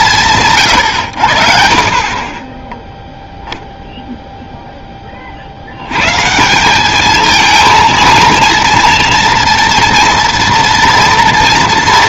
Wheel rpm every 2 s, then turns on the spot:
120, 0, 30, 210, 230, 230.
none